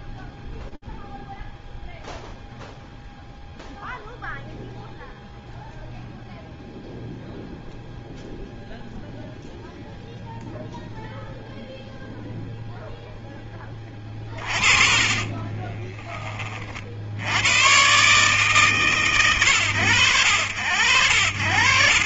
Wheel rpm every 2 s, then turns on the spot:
0, 0, 0, 0, 0, 0, 10, 30, 90, 130, 100.
14-16